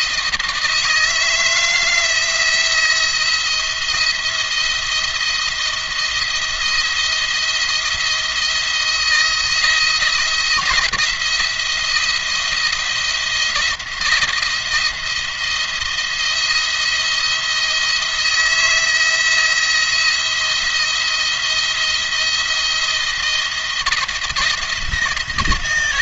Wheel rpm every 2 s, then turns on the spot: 160, 170, 170, 170, 170, 170, 170, 170, 170, 170, 170, 170, 170.
none